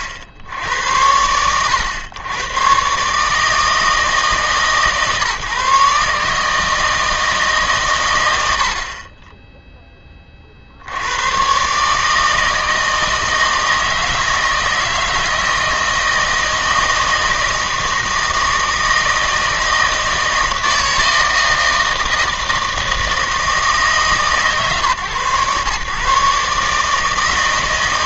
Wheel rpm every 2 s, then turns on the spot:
80, 130, 140, 160, 70, 60, 160, 160, 160, 160, 160, 160, 130, 150.
none